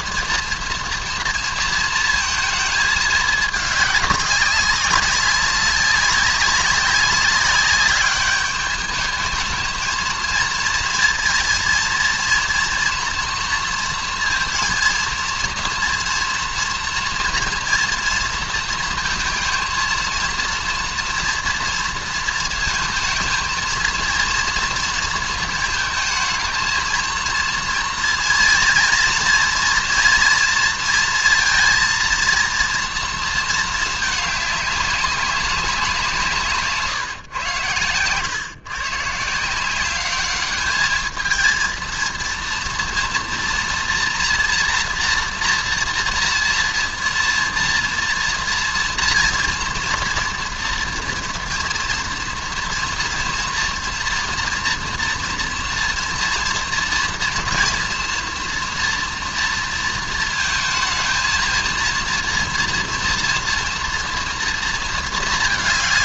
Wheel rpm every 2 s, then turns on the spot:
230, 220, 200, 190, 210, 230, 230, 230, 240, 230, 230, 230, 230, 220, 230, 230, 230, 210, 160, 120, 210, 230, 240, 230, 230, 230, 230, 230, 230, 230, 220, 230, 230.
36-38